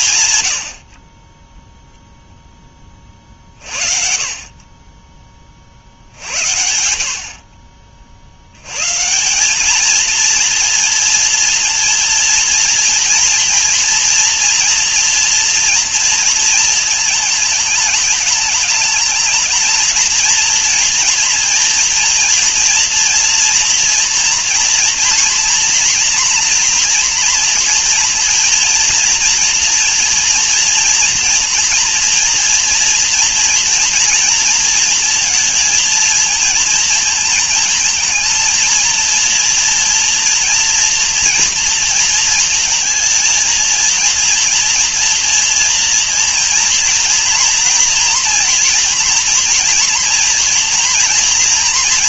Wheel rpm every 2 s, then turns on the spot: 70, 20, 30, 70, 120, 230, 230, 230, 220, 210, 230, 230, 240, 240, 230, 230, 230, 230, 220, 230, 230, 220, 230, 240, 230, 230.
none